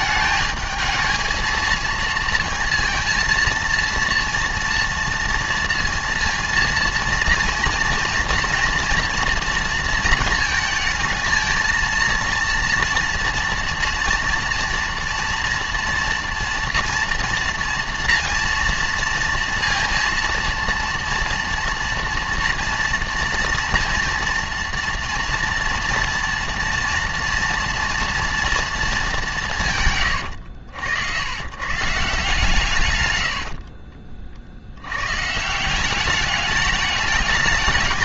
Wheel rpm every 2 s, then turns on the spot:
220, 230, 230, 230, 230, 220, 240, 230, 240, 230, 230, 230, 230, 230, 190, 100, 90, 130, 210.
none